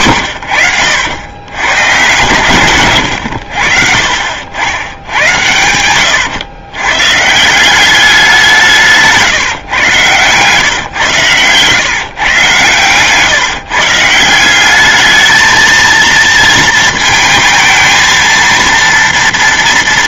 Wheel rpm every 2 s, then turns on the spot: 90, 130, 80, 110, 180, 130, 130, 180, 230, 230.
none